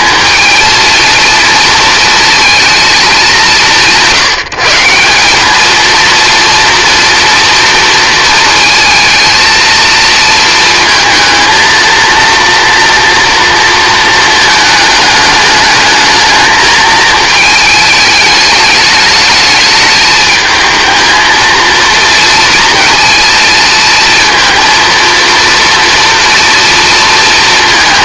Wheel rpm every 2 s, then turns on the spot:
230, 220, 160, 230, 230, 230, 230, 220, 220, 210, 220, 230, 230, 230.
none